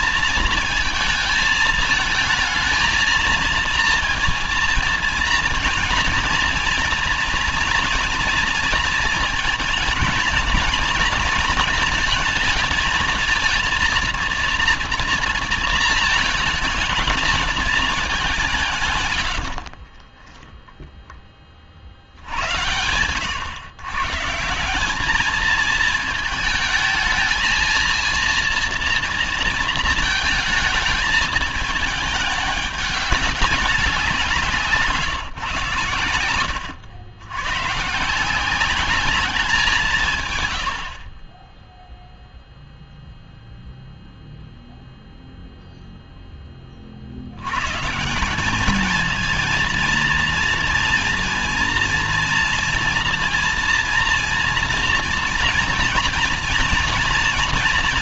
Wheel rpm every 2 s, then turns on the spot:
220, 220, 230, 230, 230, 230, 220, 230, 220, 110, 20, 110, 210, 220, 230, 220, 200, 150, 110, 200, 40, 0, 0, 80, 220, 230, 230, 230, 230.
18-20